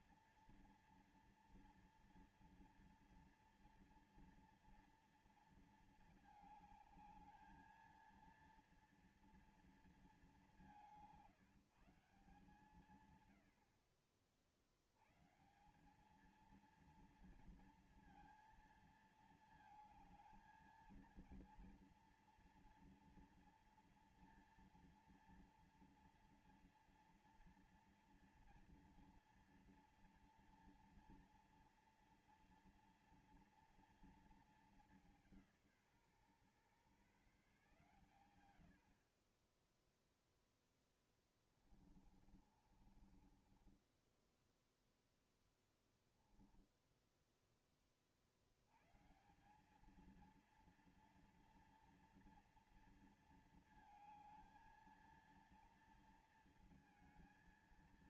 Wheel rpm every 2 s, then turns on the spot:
240, 230, 230, 220, 220, 210, 160, 60, 210, 230, 220, 230, 230, 230, 230, 230, 230, 230, 150, 110, 0, 30, 10, 0, 60, 220, 230, 220, 230.
42-46